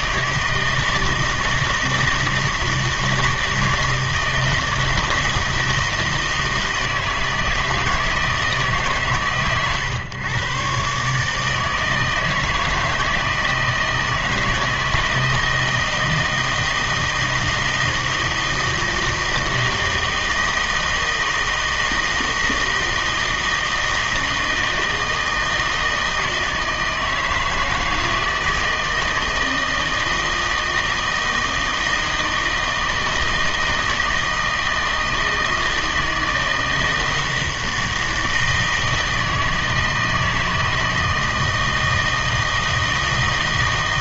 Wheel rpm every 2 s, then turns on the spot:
160, 160, 160, 160, 150, 130, 160, 160, 160, 160, 160, 160, 160, 160, 160, 160, 160, 160, 160, 160, 160, 160.
none